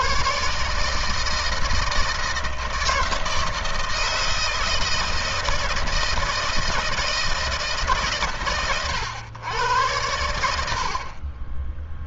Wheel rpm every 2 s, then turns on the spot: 150, 160, 160, 160, 130, 70.
none